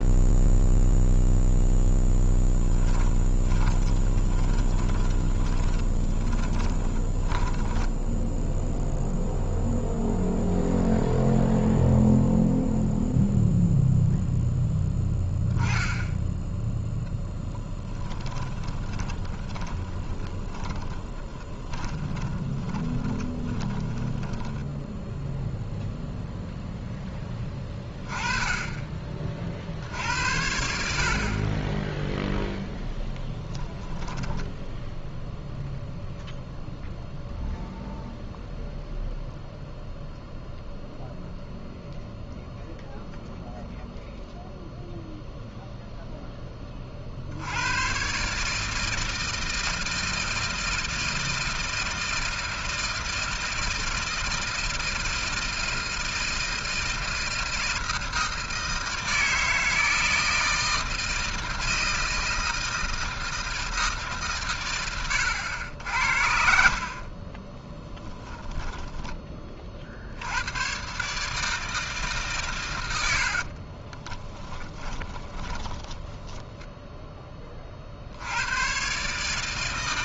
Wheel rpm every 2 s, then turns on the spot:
0, 10, 20, 20, 0, 0, 0, 0, 0, 10, 20, 20, 10, 10, 20, 60, 20, 10, 0, 0, 0, 0, 0, 40, 160, 160, 160, 160, 160, 160, 160, 160, 130, 60, 10, 110, 130, 20, 10, 90.
2-8 18-26 34-36 68-70 74-78